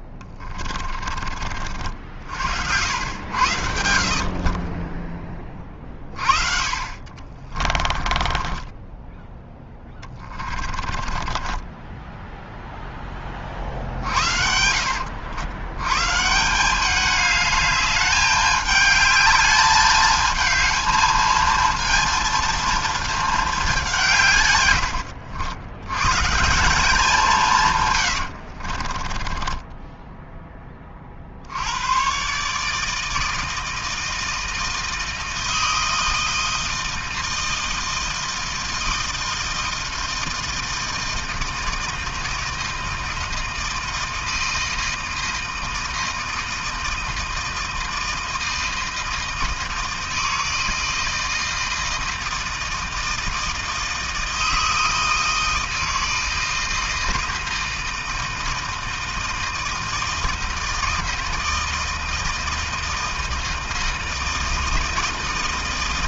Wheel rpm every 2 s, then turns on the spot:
30, 70, 30, 50, 20, 20, 0, 70, 190, 210, 220, 230, 100, 190, 50, 20, 150, 160, 160, 160, 160, 160, 160, 160, 160, 160, 160, 160, 160, 160, 160, 160, 160.
0-2 4-12 28-30